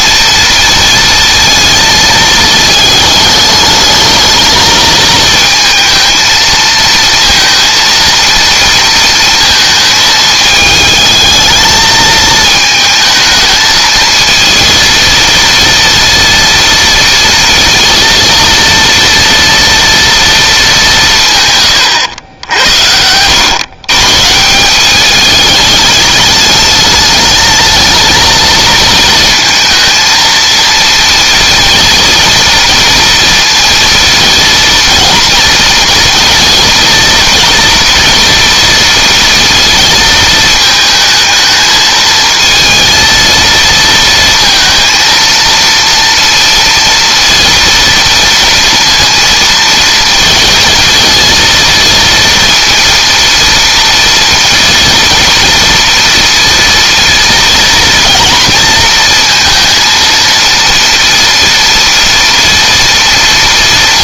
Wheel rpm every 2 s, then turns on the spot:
230, 210, 220, 230, 230, 220, 220, 230, 230, 230, 170, 80, 190, 210, 220, 230, 230, 230, 230, 230, 220, 230, 230, 230, 230, 230, 230, 230, 230, 230, 230, 230.
none